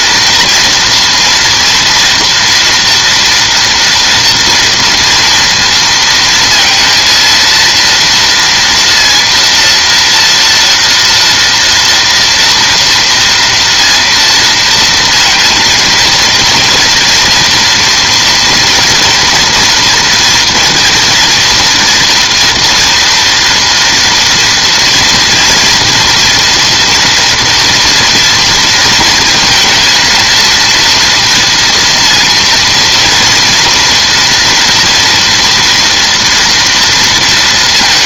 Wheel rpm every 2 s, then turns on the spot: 230, 230, 230, 230, 230, 230, 230, 230, 230, 240, 230, 230, 230, 230, 230, 230, 230, 230, 230.
none